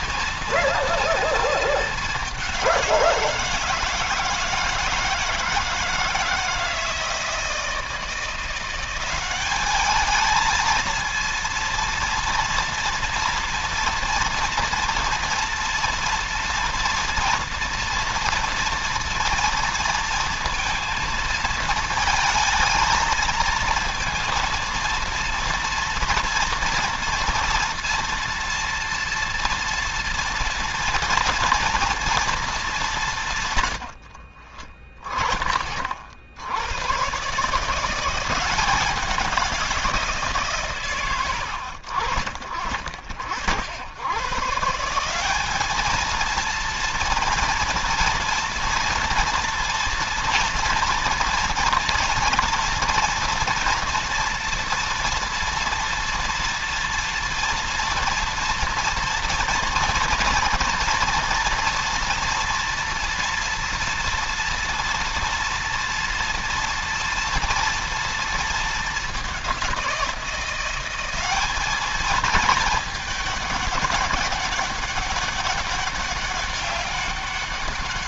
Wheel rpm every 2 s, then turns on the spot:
230, 180, 160, 160, 180, 230, 230, 240, 230, 230, 230, 220, 230, 230, 230, 230, 200, 20, 90, 180, 130, 50, 150, 230, 230, 230, 230, 230, 240, 230, 230, 230, 230, 230, 210, 180, 220, 200, 200.
none